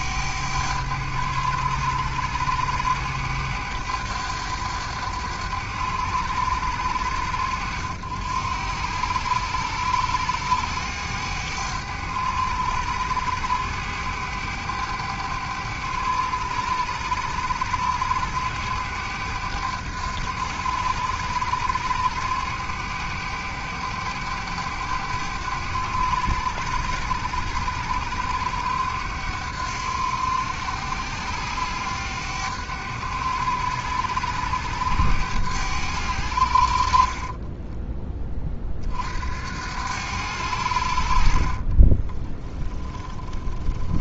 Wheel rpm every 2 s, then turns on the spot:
100, 100, 100, 90, 90, 100, 100, 100, 100, 100, 100, 100, 100, 90, 90, 90, 100, 100, 50, 50, 70, 20.
42-44